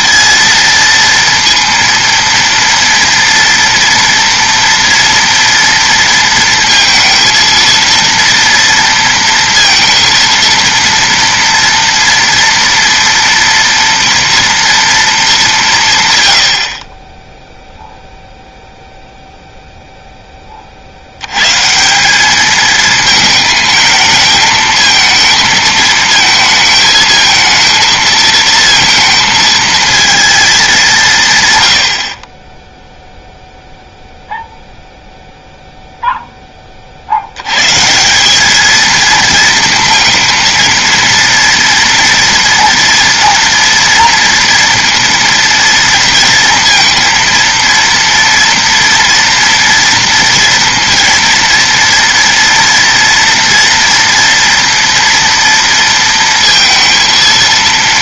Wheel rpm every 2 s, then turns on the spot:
230, 230, 230, 230, 230, 230, 230, 230, 50, 0, 30, 210, 220, 220, 230, 210, 10, 0, 30, 220, 230, 230, 230, 230, 230, 230, 230, 230, 230.
none